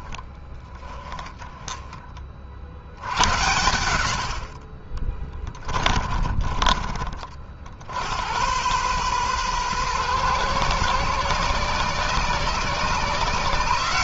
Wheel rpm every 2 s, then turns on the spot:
20, 70, 40, 50, 120, 120, 130.
4-6